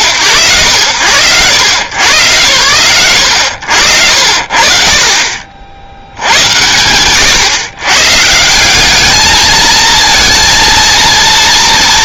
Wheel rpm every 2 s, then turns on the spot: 120, 100, 60, 70, 150, 230.
none